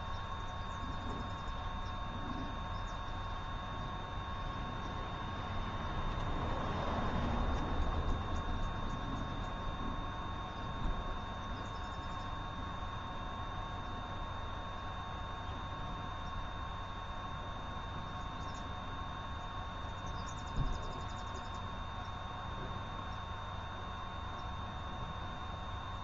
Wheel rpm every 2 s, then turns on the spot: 0, 0, 0, 0, 0, 0, 0, 0, 0, 0, 0, 0, 0.
none